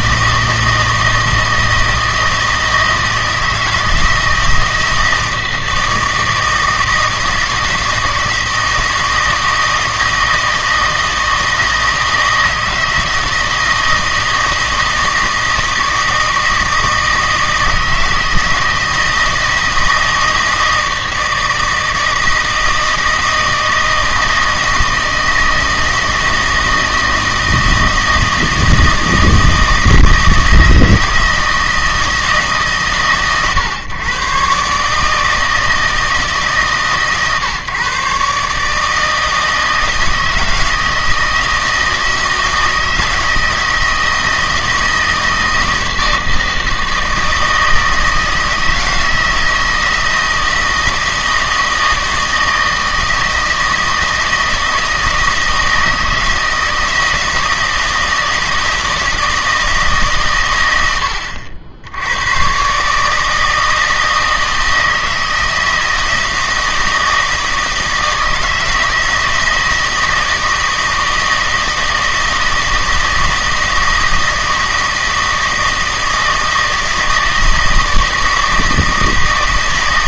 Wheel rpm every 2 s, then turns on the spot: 160, 160, 160, 160, 160, 160, 160, 160, 160, 160, 160, 160, 160, 160, 160, 160, 150, 140, 150, 150, 160, 160, 160, 160, 160, 160, 160, 160, 160, 160, 110, 130, 160, 160, 160, 160, 160, 160, 160, 160.
none